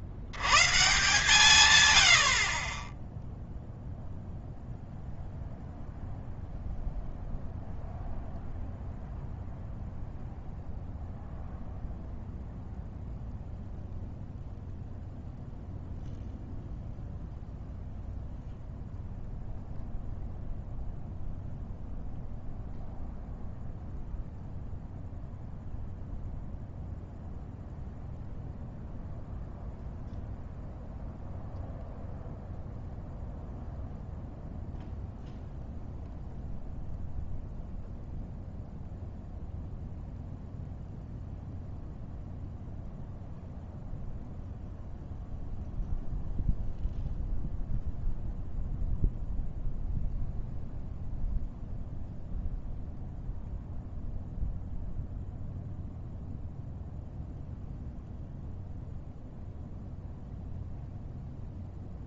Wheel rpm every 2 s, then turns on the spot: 150, 30, 0, 0, 0, 0, 0, 0, 0, 0, 0, 0, 0, 0, 0, 0, 0, 0, 0, 0, 0, 0, 0, 0, 0, 0, 0, 0, 0, 0, 0.
none